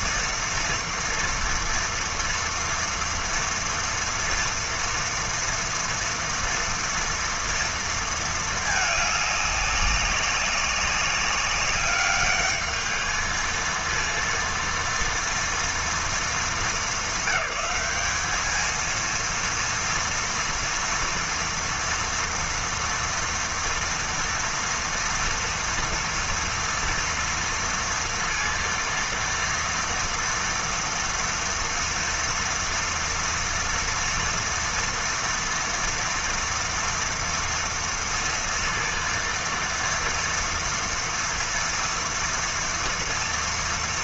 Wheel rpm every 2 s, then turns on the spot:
230, 230, 230, 230, 210, 200, 220, 230, 200, 230, 230, 230, 230, 230, 230, 240, 230, 230, 230, 230, 230, 230.
none